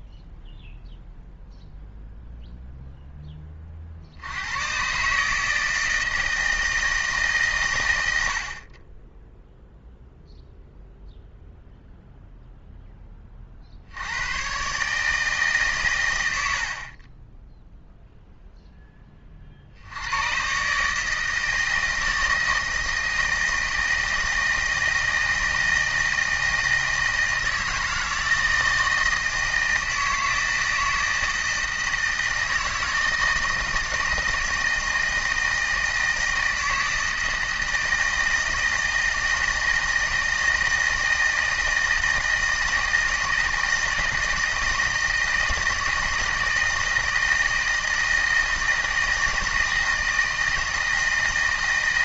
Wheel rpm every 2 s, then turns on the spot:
0, 0, 120, 160, 30, 0, 10, 130, 60, 10, 140, 160, 160, 160, 160, 160, 160, 160, 160, 160, 160, 160, 160, 160, 160, 160.
none